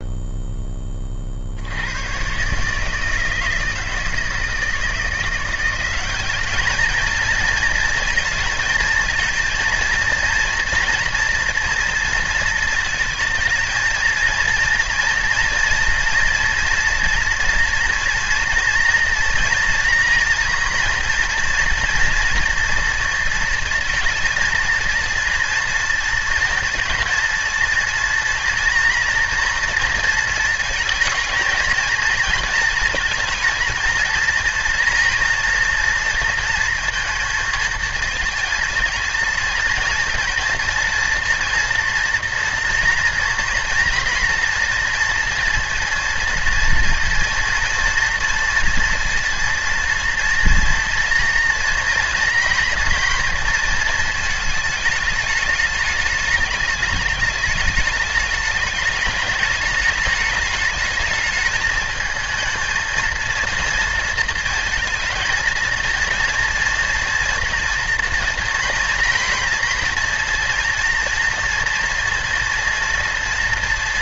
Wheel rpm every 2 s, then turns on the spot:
10, 150, 160, 210, 220, 240, 230, 230, 230, 230, 230, 230, 230, 230, 230, 220, 230, 240, 230, 230, 230, 240, 230, 230, 230, 230, 230, 210, 210, 210, 210, 220, 220, 240, 240, 240, 230.
none